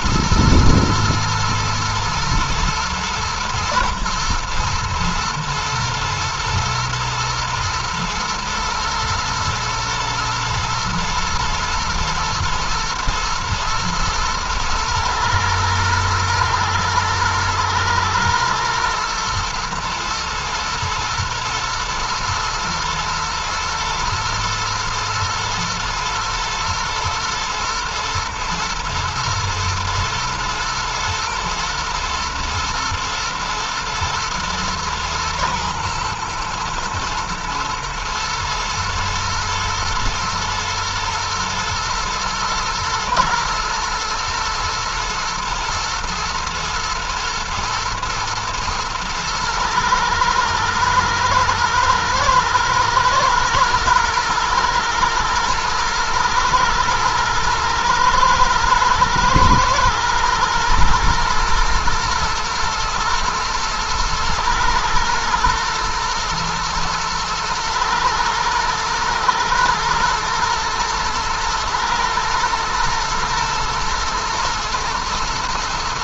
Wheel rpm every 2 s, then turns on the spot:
110, 110, 110, 120, 120, 120, 120, 110, 110, 110, 110, 120, 120, 110, 110, 110, 110, 110, 110, 120, 120, 110, 110, 120, 110, 110, 110, 110, 110, 110, 110, 120, 120, 120, 110, 110, 110, 110.
none